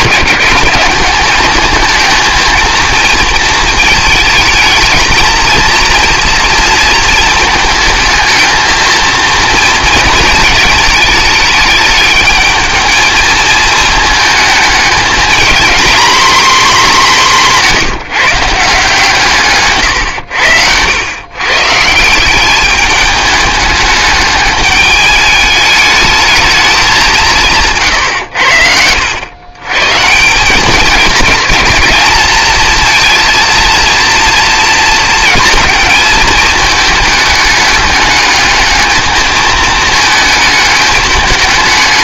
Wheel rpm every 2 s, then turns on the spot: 200, 230, 220, 230, 220, 220, 220, 220, 230, 160, 100, 210, 210, 200, 90, 200, 220, 230, 220, 220, 210.
none